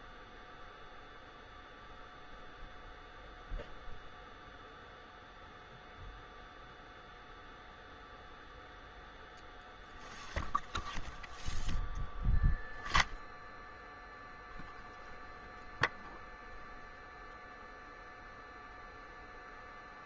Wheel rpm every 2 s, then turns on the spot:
0, 0, 0, 0, 0, 0, 0, 0, 0, 0.
none